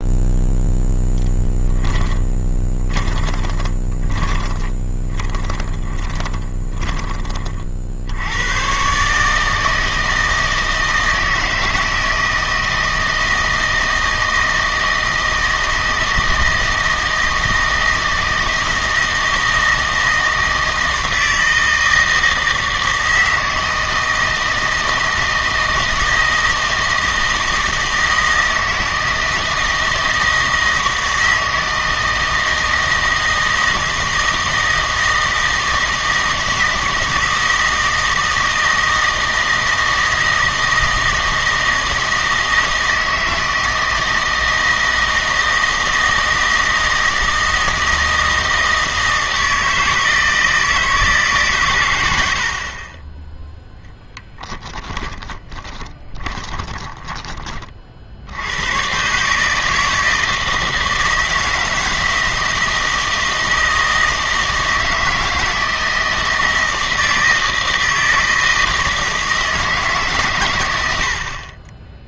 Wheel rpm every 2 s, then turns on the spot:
0, 20, 20, 20, 120, 160, 160, 160, 160, 160, 160, 160, 160, 160, 160, 160, 160, 160, 160, 160, 160, 160, 160, 160, 160, 160, 40, 20, 20, 100, 160, 160, 160, 160, 160, 90.
2-8 54-58